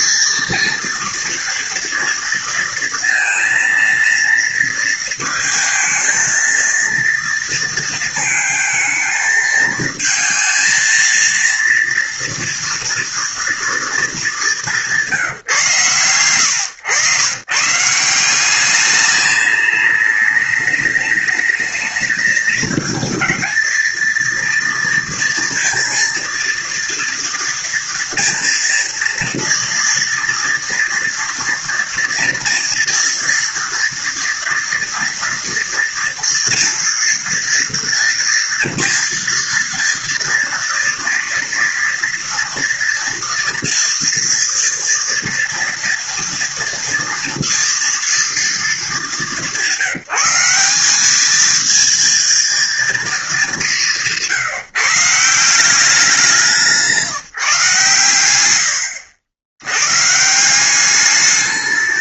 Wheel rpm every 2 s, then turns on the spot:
230, 230, 230, 230, 220, 230, 230, 190, 120, 200, 210, 230, 230, 230, 230, 230, 230, 230, 230, 230, 230, 230, 240, 240, 210, 200, 230, 160, 170, 90, 190.
none